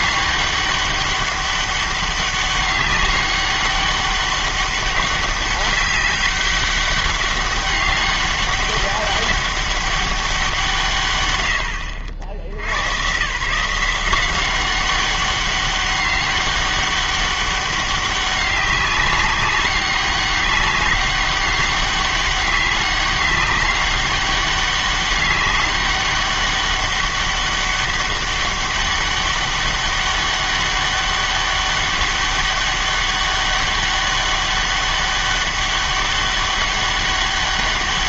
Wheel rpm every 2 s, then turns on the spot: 200, 200, 200, 200, 200, 160, 100, 190, 200, 190, 200, 200, 200, 200, 200, 200, 200, 200, 200.
none